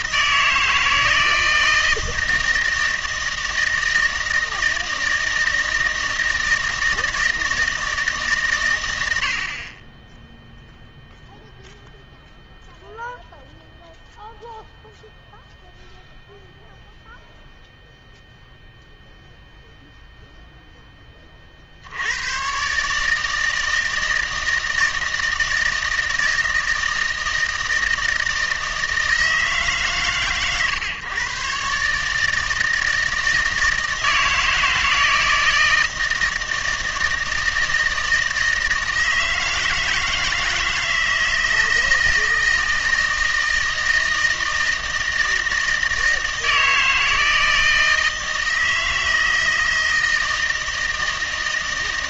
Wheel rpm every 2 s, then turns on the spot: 160, 160, 160, 160, 110, 0, 0, 0, 0, 0, 10, 140, 160, 160, 160, 130, 160, 160, 160, 160, 160, 160, 160, 160, 160, 160.
none